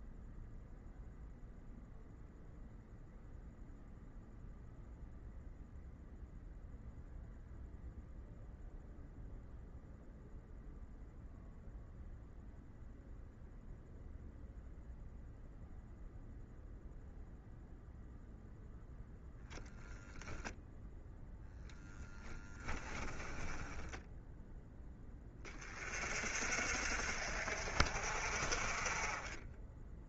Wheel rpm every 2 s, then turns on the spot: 0, 0, 0, 0, 0, 0, 0, 0, 0, 0, 0, 10, 10, 50, 40.
22-24